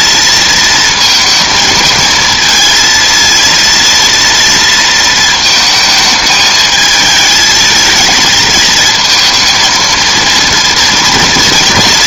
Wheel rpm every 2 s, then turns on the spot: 230, 220, 230, 220, 220, 230.
none